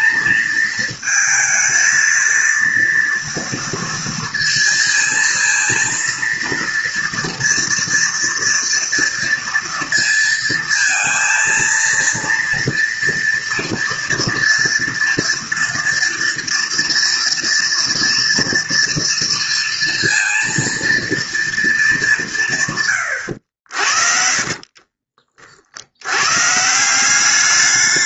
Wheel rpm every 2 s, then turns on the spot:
230, 230, 230, 230, 230, 230, 240, 230, 240, 230, 230, 120, 30, 180.
none